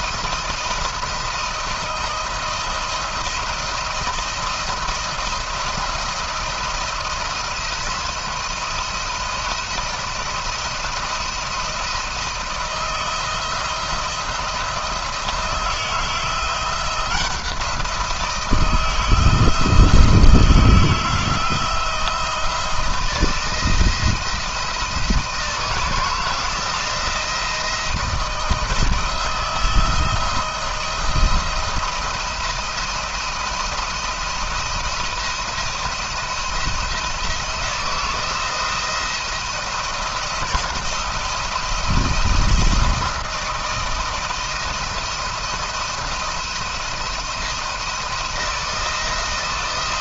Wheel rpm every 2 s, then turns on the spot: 170, 170, 170, 170, 170, 170, 160, 170, 170, 170, 160, 160, 170, 170, 170, 170, 170, 170, 160, 170, 170, 170, 160, 170, 170.
none